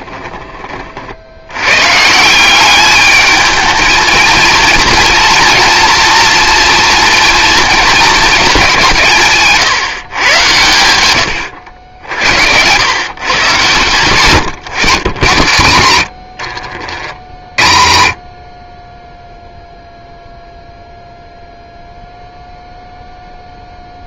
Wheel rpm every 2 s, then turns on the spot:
30, 190, 230, 230, 200, 100, 100, 120, 40, 20, 0, 0.
none